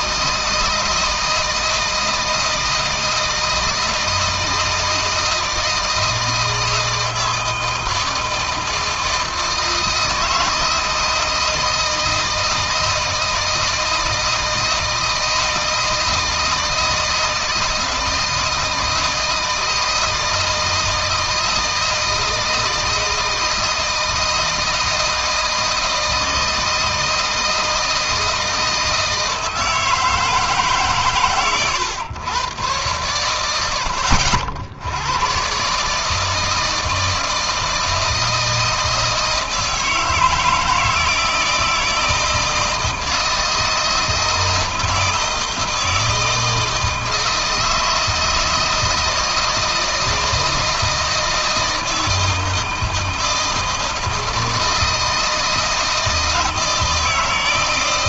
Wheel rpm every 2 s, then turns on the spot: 160, 160, 160, 160, 160, 160, 160, 160, 160, 160, 160, 160, 160, 160, 160, 150, 120, 90, 160, 160, 160, 160, 160, 160, 160, 160, 160, 160, 160.
none